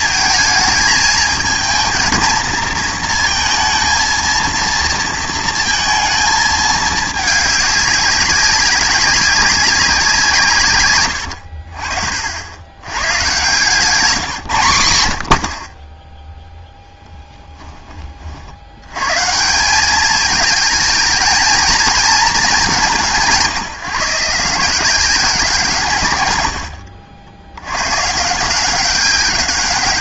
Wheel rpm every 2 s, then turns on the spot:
220, 220, 230, 220, 190, 130, 90, 120, 0, 90, 220, 200, 170, 90, 180.
none